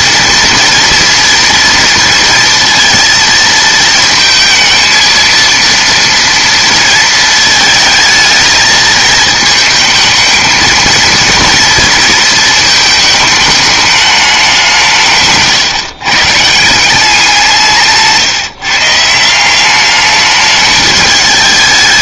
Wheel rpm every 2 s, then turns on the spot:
230, 230, 220, 230, 220, 220, 220, 180, 160, 150, 210.
none